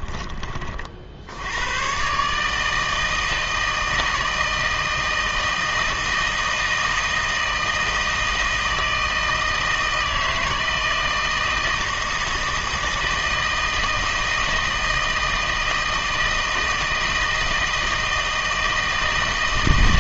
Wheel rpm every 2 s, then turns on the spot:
40, 160, 160, 160, 160, 160, 160, 160, 160, 160.
none